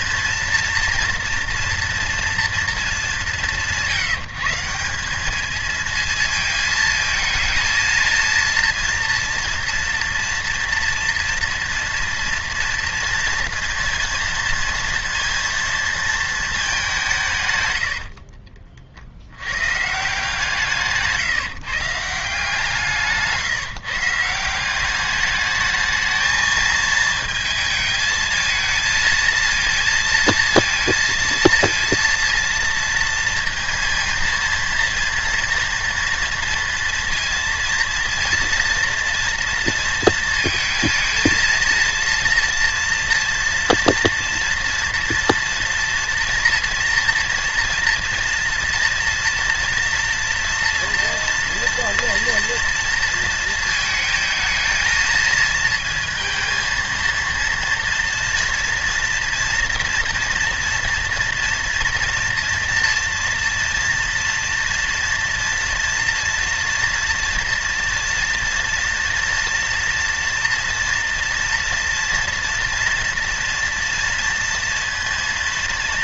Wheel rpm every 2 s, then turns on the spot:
230, 210, 170, 220, 230, 230, 230, 230, 200, 30, 150, 170, 180, 220, 220, 230, 230, 230, 230, 230, 230, 230, 230, 230, 230, 230, 230, 220, 230, 230, 230, 230, 230, 230, 240, 230, 230, 230.
none